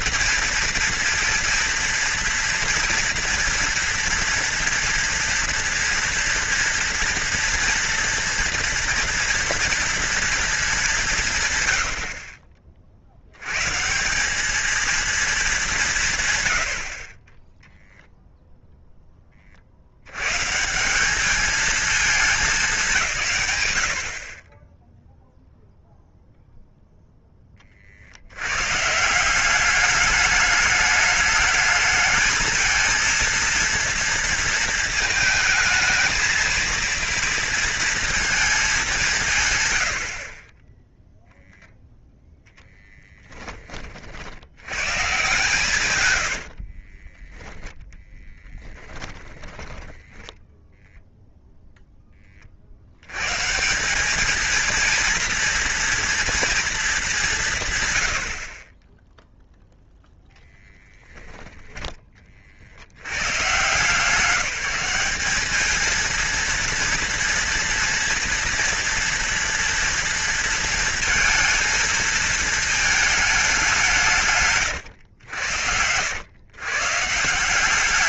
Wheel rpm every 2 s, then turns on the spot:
230, 230, 230, 230, 230, 210, 50, 220, 80, 0, 160, 190, 20, 0, 130, 210, 220, 230, 230, 210, 20, 10, 100, 40, 10, 0, 70, 220, 220, 30, 10, 90, 180, 230, 230, 230, 220, 130, 140.
46-50 74-76